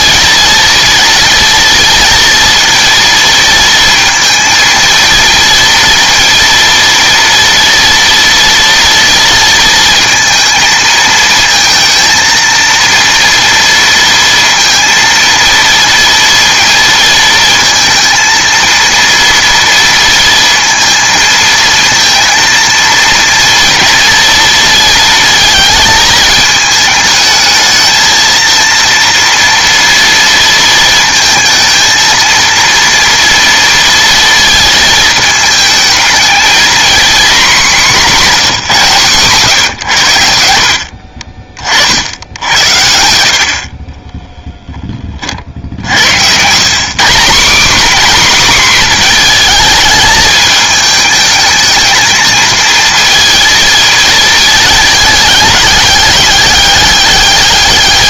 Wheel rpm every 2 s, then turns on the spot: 230, 230, 230, 230, 230, 230, 230, 230, 230, 230, 230, 230, 230, 220, 230, 230, 230, 220, 240, 180, 60, 80, 10, 170, 250, 220, 230, 210, 200.
none